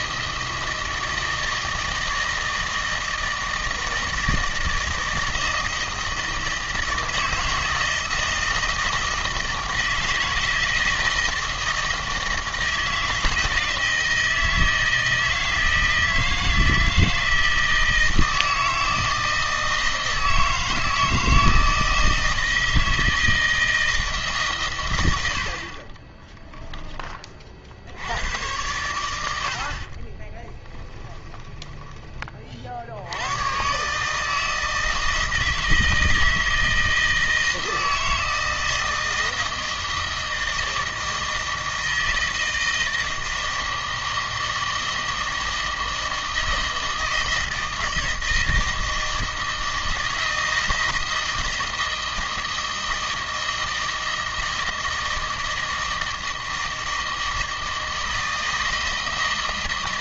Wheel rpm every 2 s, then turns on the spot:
160, 160, 160, 160, 160, 160, 160, 160, 160, 160, 160, 160, 120, 10, 100, 20, 60, 160, 160, 160, 160, 170, 160, 160, 160, 160, 160, 160, 160, 160.
30-32